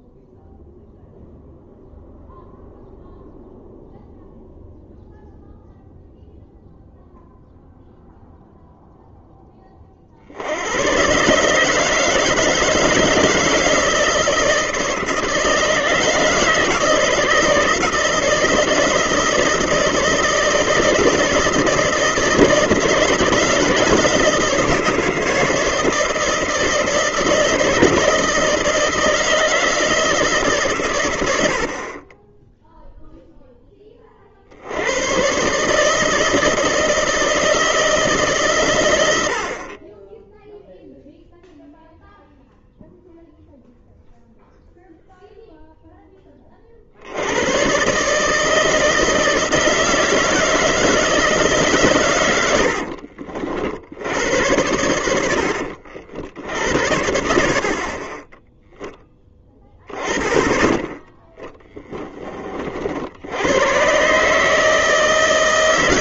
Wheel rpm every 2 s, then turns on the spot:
0, 0, 0, 0, 0, 80, 160, 160, 160, 160, 160, 160, 160, 160, 160, 140, 10, 60, 160, 120, 0, 0, 0, 40, 160, 160, 100, 90, 70, 10, 10, 30, 150.
none